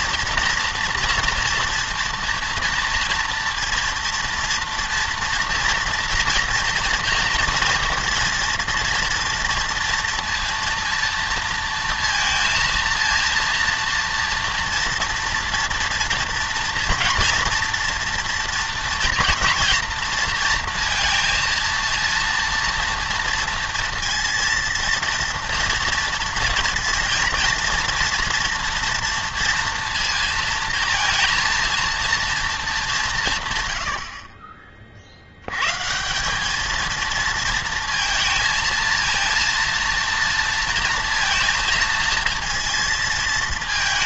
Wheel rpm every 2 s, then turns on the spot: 230, 230, 230, 240, 230, 230, 230, 230, 230, 230, 230, 230, 230, 230, 230, 230, 210, 30, 220, 220, 230, 230.
none